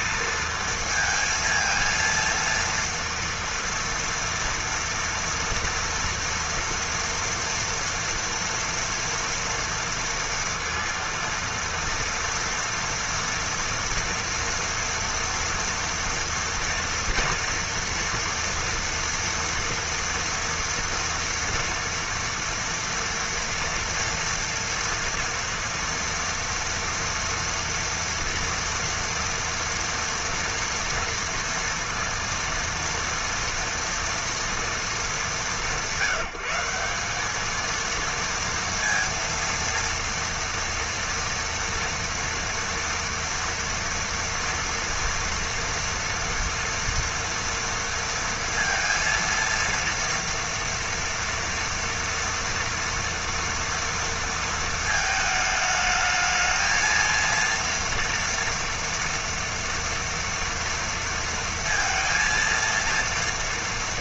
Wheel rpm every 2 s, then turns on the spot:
230, 230, 230, 230, 230, 230, 230, 230, 240, 230, 230, 230, 230, 230, 230, 230, 230, 210, 190, 230, 230, 230, 230, 240, 230, 230, 230, 220, 230, 230, 230, 230.
none